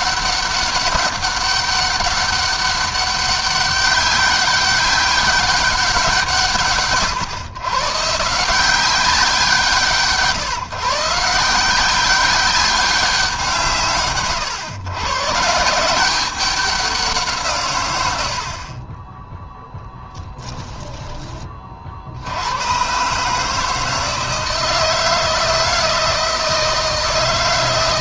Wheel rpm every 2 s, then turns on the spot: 200, 200, 200, 130, 180, 160, 180, 130, 180, 30, 20, 130, 160, 160.
none